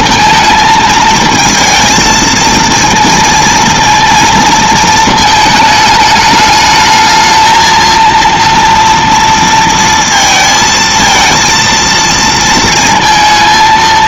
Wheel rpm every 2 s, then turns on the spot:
220, 230, 230, 210, 230, 220, 230.
none